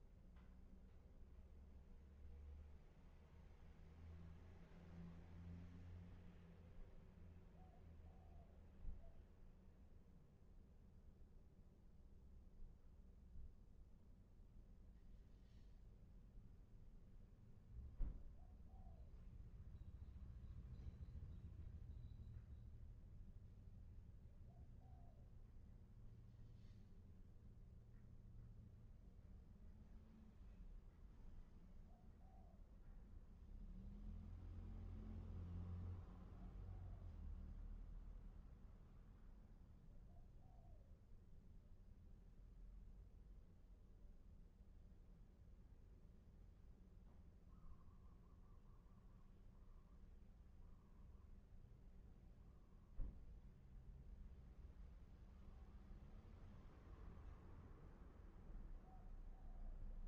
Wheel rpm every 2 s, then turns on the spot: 0, 0, 0, 0, 0, 0, 0, 0, 0, 0, 0, 0, 0, 0, 0, 0, 0, 0, 0, 0, 0, 0, 0, 0, 0, 0, 0, 0, 0, 0.
none